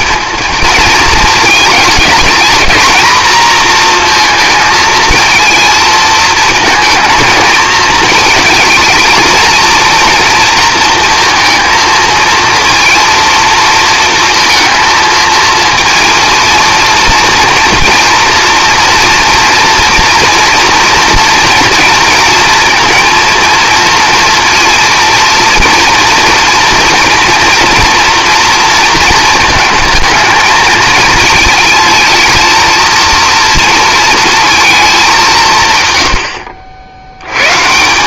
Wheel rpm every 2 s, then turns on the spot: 230, 230, 220, 220, 220, 230, 230, 230, 230, 230, 240, 230, 230, 240, 230, 220, 230, 220, 80.
none